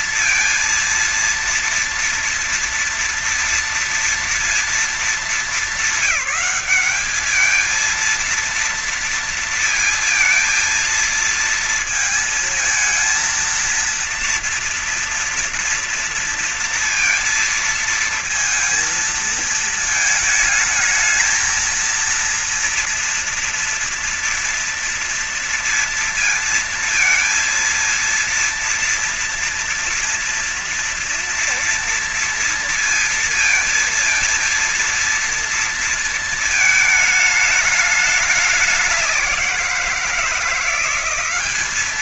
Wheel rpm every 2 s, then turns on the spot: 230, 230, 220, 200, 230, 230, 230, 230, 230, 230, 220, 230, 230, 230, 230, 230, 230, 230, 220, 200, 180.
none